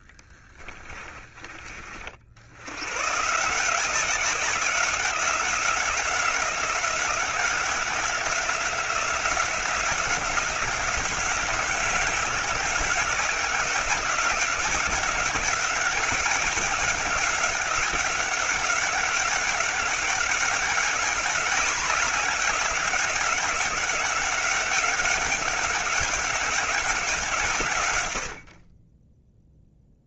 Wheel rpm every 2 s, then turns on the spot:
30, 120, 180, 180, 180, 190, 180, 190, 200, 190, 200, 190, 190, 190, 30.
none